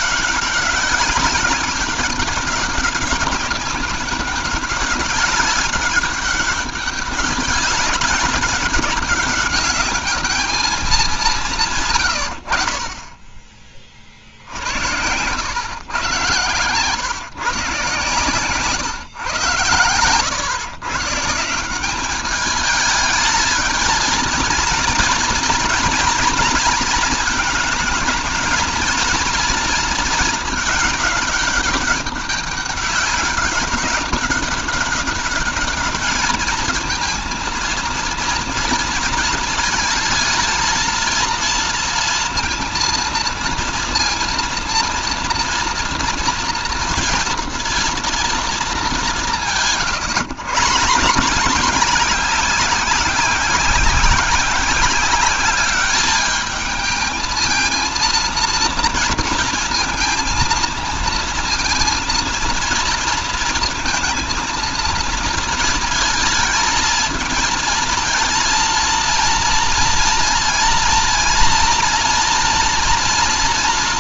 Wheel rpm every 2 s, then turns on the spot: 190, 200, 200, 200, 200, 210, 60, 70, 120, 130, 120, 210, 220, 220, 220, 220, 200, 200, 220, 230, 230, 230, 230, 230, 210, 140, 190, 190, 220, 230, 230, 230, 230, 220, 230, 230, 230.
none